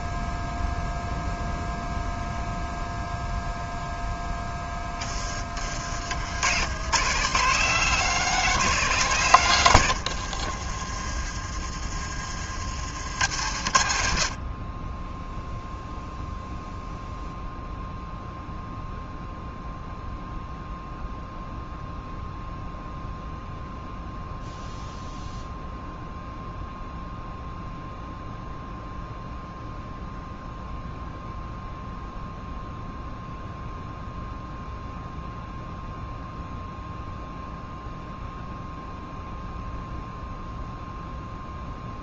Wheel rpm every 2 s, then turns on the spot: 0, 0, 20, 110, 140, 30, 70, 10, 0, 0, 0, 0, 0, 0, 0, 0, 0, 0, 0, 0, 0.
10-12